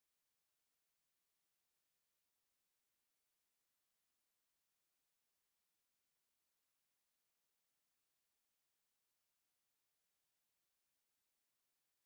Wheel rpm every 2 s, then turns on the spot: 20, 0, 0, 0, 0, 0.
none